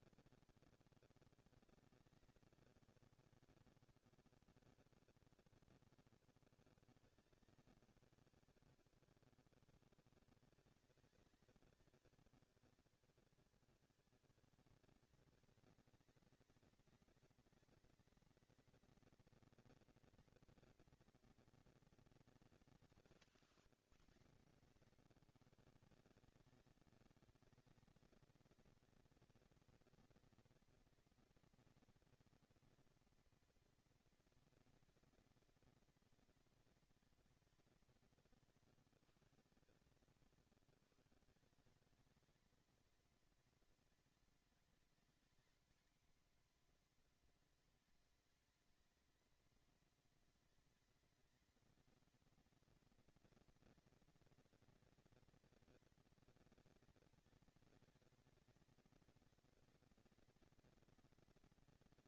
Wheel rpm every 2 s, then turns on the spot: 200, 200, 200, 200, 200, 200, 200, 200, 220, 220, 230, 200, 180, 180, 220, 230, 230, 230, 230, 180, 160, 210, 220, 230, 220, 220, 220, 230, 220, 230, 240.
38-40